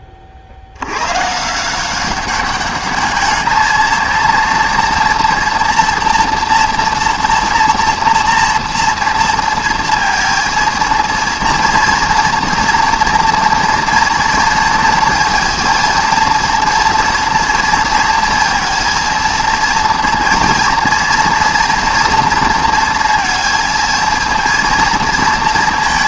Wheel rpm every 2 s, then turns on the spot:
80, 200, 230, 240, 230, 230, 230, 230, 240, 230, 230, 230, 230.
none